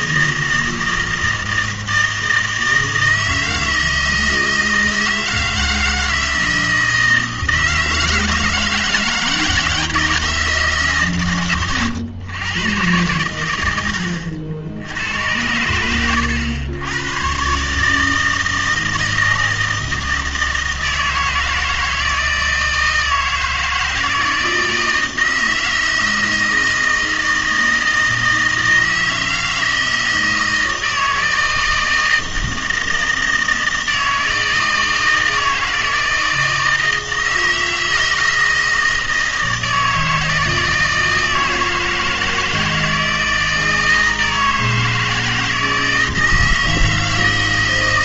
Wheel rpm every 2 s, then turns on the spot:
160, 160, 160, 160, 160, 150, 110, 80, 100, 160, 160, 160, 160, 160, 160, 160, 160, 160, 160, 160, 160, 160, 160, 160.
none